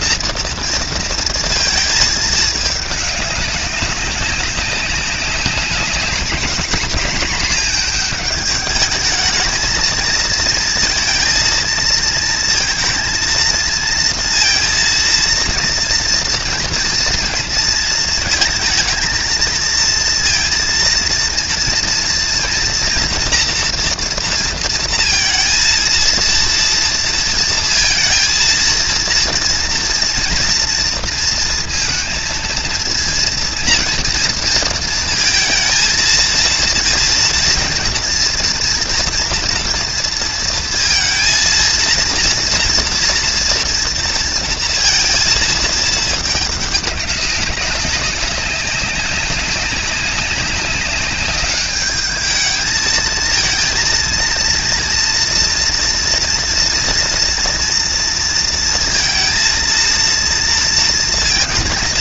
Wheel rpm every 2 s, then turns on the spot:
230, 210, 190, 220, 210, 220, 230, 230, 230, 230, 230, 240, 230, 230, 230, 230, 230, 230, 230, 230, 230, 230, 230, 200, 190, 200, 220, 230, 230, 230, 230.
none